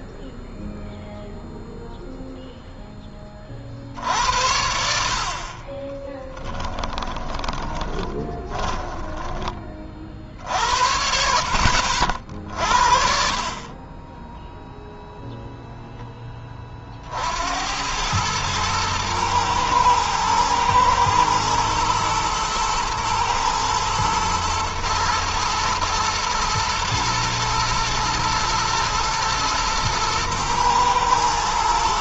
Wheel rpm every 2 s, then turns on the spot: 0, 10, 70, 20, 10, 60, 50, 0, 40, 110, 110, 120, 110, 120, 110, 120.
6-10 12-14